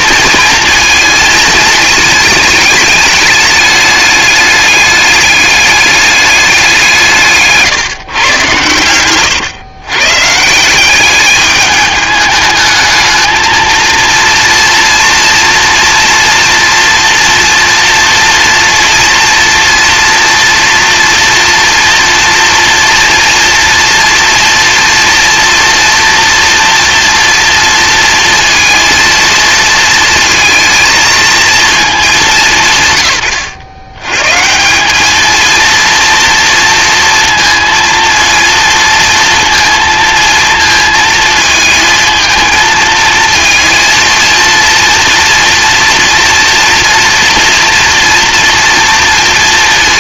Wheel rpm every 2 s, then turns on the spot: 230, 210, 210, 190, 110, 170, 210, 230, 240, 230, 230, 230, 230, 230, 230, 230, 150, 180, 230, 230, 230, 220, 230, 230, 230.
8-10